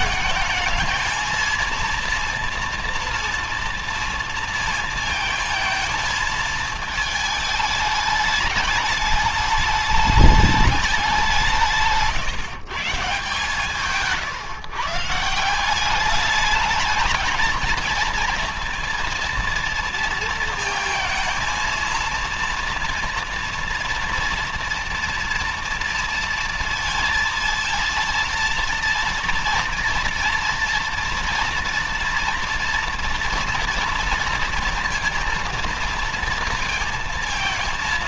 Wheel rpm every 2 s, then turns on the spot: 220, 230, 230, 220, 210, 210, 150, 140, 220, 230, 230, 230, 230, 230, 230, 230, 230, 230, 230.
none